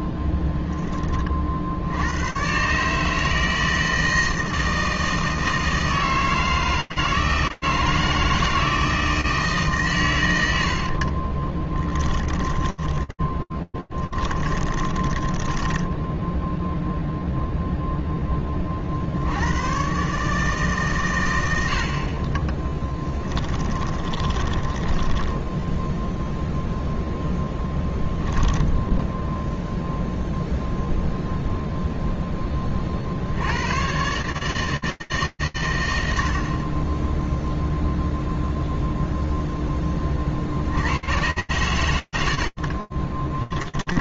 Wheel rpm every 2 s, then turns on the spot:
20, 90, 160, 160, 160, 110, 20, 10, 0, 60, 120, 20, 0, 10, 0, 0, 120, 100, 0, 20, 100, 10.
0-2 12-16 22-24 26-28 40-44